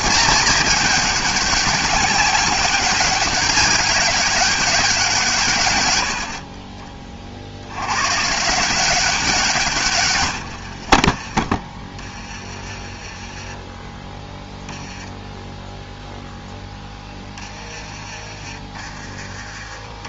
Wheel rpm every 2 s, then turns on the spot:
200, 200, 190, 40, 160, 70, 20, 10, 0, 30.
10-12